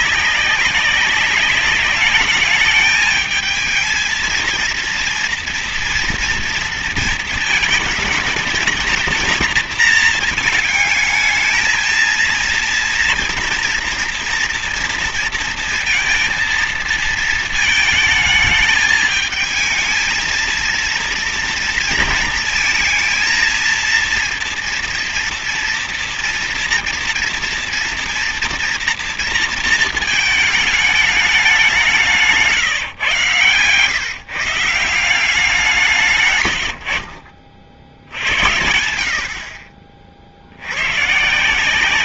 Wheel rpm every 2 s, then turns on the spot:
190, 210, 230, 230, 230, 220, 230, 230, 220, 220, 230, 230, 230, 230, 230, 210, 150, 160, 100, 80, 100.
none